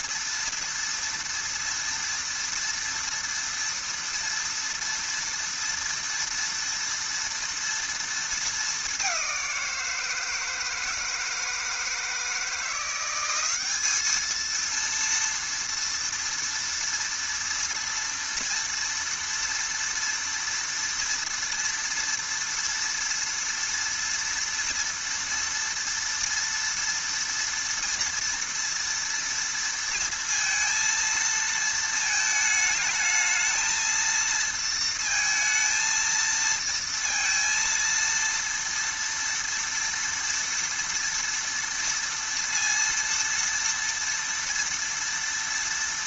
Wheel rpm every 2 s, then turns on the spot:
230, 230, 230, 230, 210, 160, 170, 230, 230, 230, 230, 240, 230, 230, 230, 230, 220, 230, 230, 230, 230, 230, 230.
none